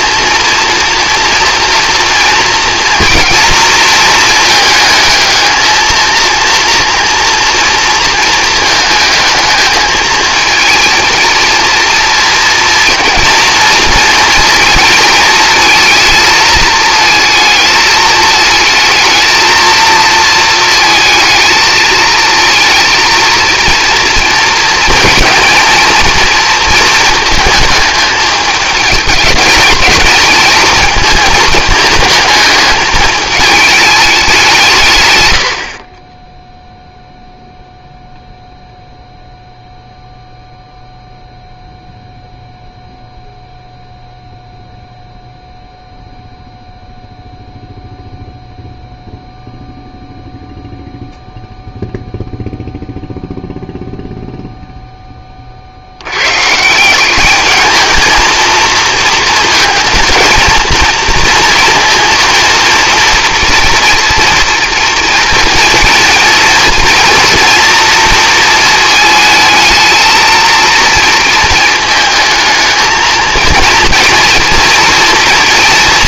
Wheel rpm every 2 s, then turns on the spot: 230, 230, 220, 230, 220, 220, 230, 220, 220, 230, 230, 230, 220, 220, 210, 230, 210, 160, 0, 0, 0, 0, 0, 0, 0, 0, 0, 0, 160, 230, 230, 230, 240, 230, 220, 230, 220, 230.
none